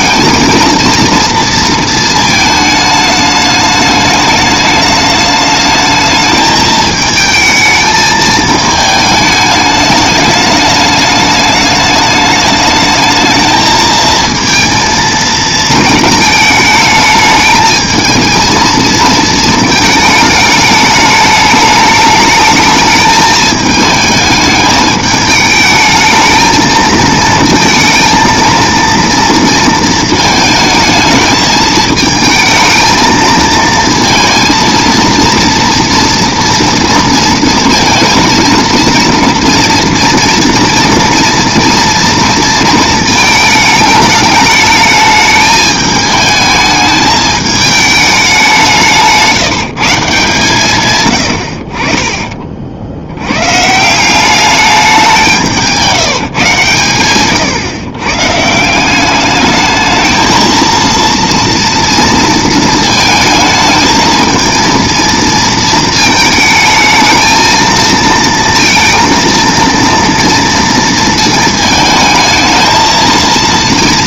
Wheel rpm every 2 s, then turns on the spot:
230, 220, 210, 220, 220, 210, 210, 230, 220, 230, 210, 210, 210, 220, 230, 220, 220, 230, 240, 230, 230, 230, 210, 220, 180, 140, 50, 200, 140, 160, 230, 230, 230, 220, 230, 230, 220.
none